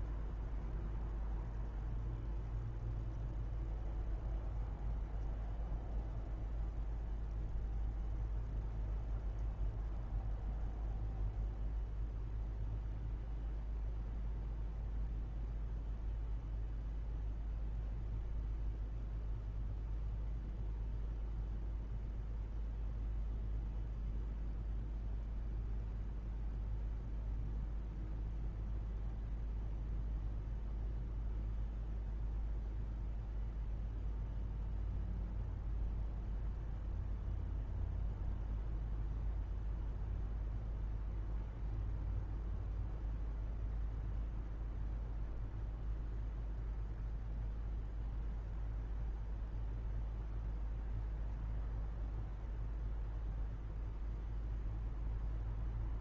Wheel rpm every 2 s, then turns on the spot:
0, 0, 0, 0, 0, 0, 0, 0, 0, 0, 0, 0, 0, 0, 0, 0, 0, 0, 0, 0, 0, 0, 0, 0, 0, 0, 0, 0.
none